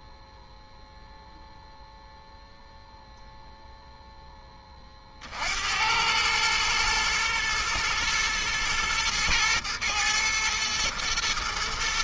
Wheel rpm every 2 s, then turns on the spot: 0, 0, 70, 110, 110, 110.
none